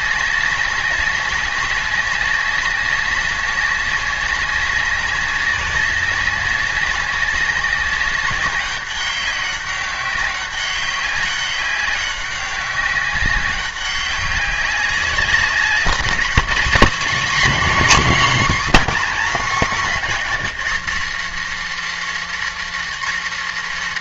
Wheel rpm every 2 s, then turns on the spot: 200, 200, 200, 200, 200, 190, 200, 190, 220, 250, 270, 310.
none